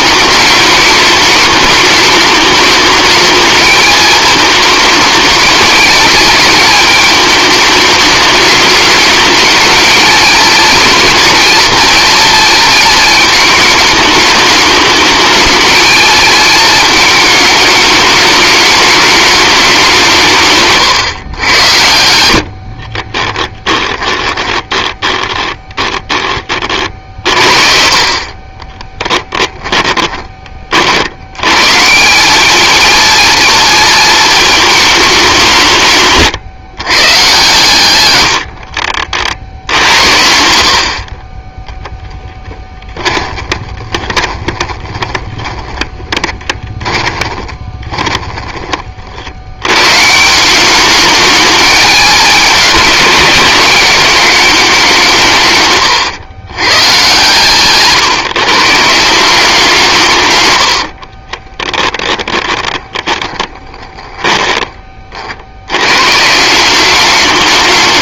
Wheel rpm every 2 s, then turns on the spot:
210, 210, 220, 210, 210, 230, 220, 210, 220, 210, 130, 30, 10, 40, 20, 50, 220, 210, 130, 50, 60, 30, 20, 20, 50, 200, 210, 190, 120, 160, 60, 20, 30, 190.
22-24 28-30 38-40 42-48 60-64